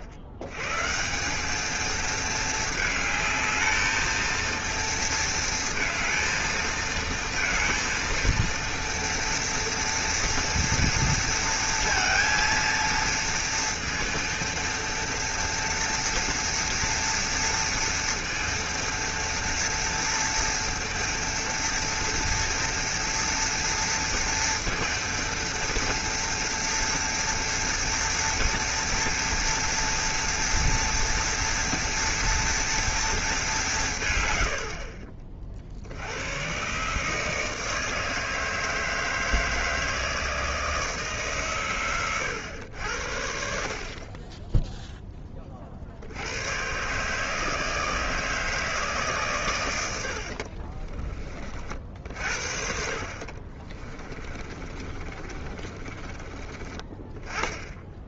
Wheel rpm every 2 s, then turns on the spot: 80, 220, 230, 230, 230, 230, 230, 230, 230, 230, 230, 230, 230, 240, 230, 230, 230, 60, 130, 160, 160, 90, 10, 120, 160, 50, 60, 30, 20.
50-52 54-56